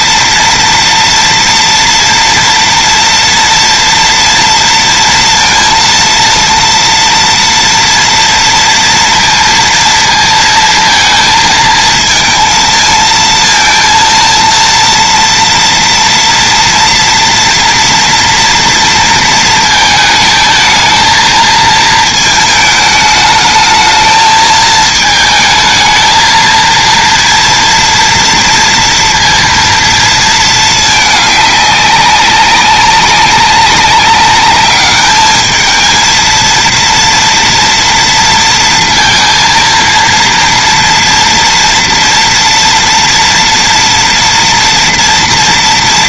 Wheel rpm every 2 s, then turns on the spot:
230, 230, 230, 230, 230, 230, 220, 230, 230, 230, 220, 220, 220, 230, 230, 210, 200, 210, 240, 230, 230, 230, 230.
none